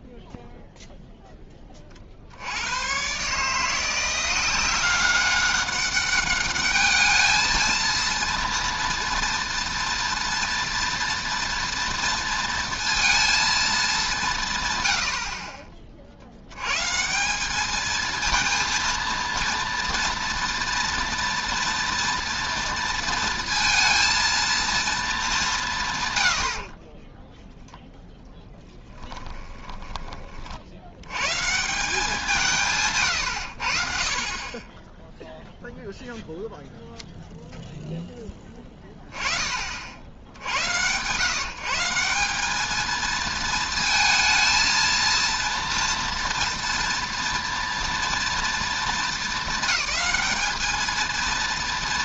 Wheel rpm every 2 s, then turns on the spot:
0, 110, 190, 210, 230, 230, 230, 100, 140, 230, 230, 230, 220, 30, 20, 90, 120, 10, 0, 20, 110, 210, 230, 230, 230, 220.
28-30